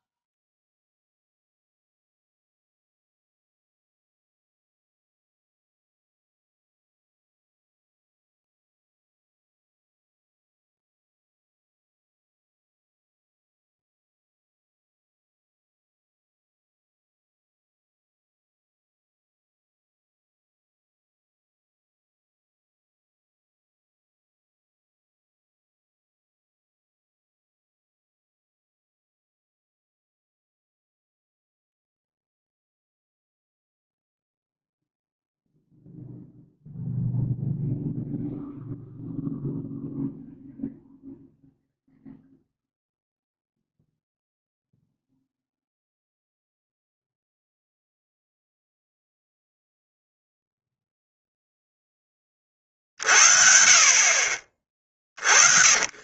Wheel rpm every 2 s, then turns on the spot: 0, 0, 0, 0, 0, 0, 0, 0, 0, 0, 0, 0, 0, 0, 0, 0, 0, 0, 0, 0, 0, 0, 0, 0, 0, 0, 40, 40.
none